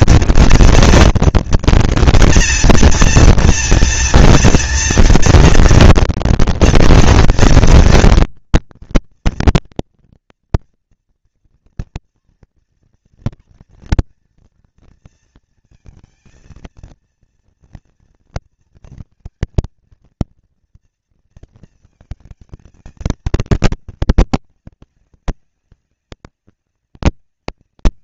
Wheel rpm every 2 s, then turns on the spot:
230, 230, 230, 230, 230, 230, 230, 230, 230, 230, 230, 220, 200, 200.
none